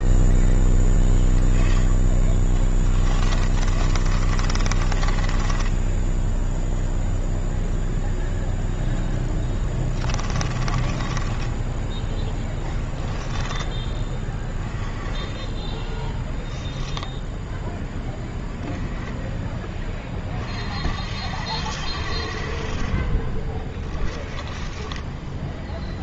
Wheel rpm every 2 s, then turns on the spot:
10, 20, 30, 0, 0, 20, 10, 20, 0, 20, 50, 40, 20.
2-6 10-12 24-26